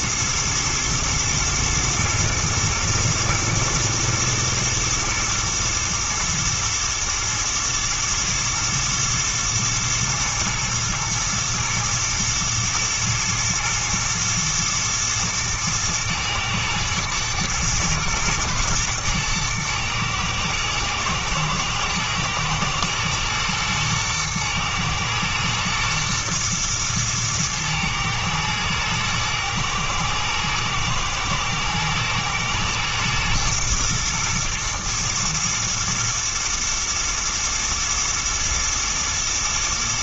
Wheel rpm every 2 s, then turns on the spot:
110, 110, 110, 110, 120, 110, 110, 120, 110, 120, 110, 120, 120, 120, 110, 120, 120, 110, 120, 110.
none